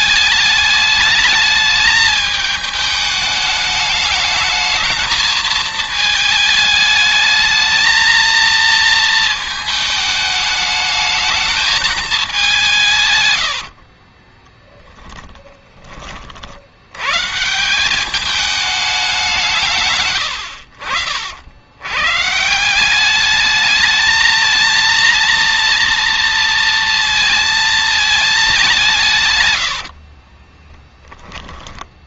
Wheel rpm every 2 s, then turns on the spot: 210, 210, 220, 220, 230, 210, 190, 20, 80, 210, 90, 170, 230, 230, 190, 20.
14-16 30-32